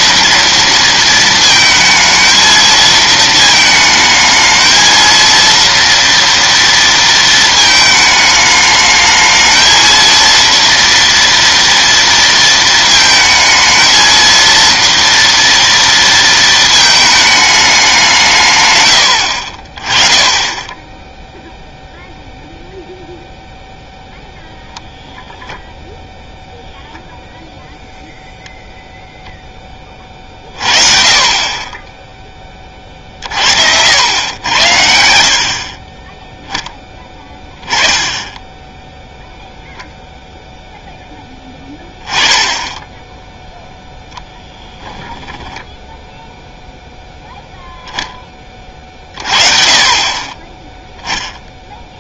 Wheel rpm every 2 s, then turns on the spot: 230, 220, 230, 230, 220, 230, 220, 230, 220, 100, 10, 0, 0, 0, 0, 50, 20, 100, 10, 10, 0, 10, 10, 0, 30, 10.
44-46